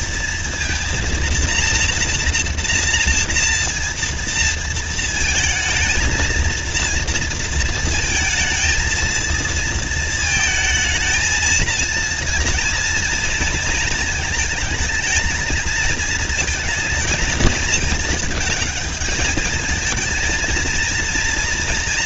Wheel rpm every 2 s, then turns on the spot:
230, 230, 230, 230, 230, 220, 230, 220, 220, 220, 220.
none